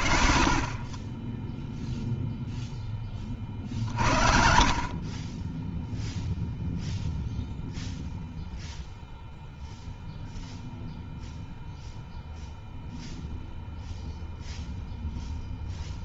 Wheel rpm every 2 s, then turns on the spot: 20, 20, 20, 0, 0, 0, 0, 10.
none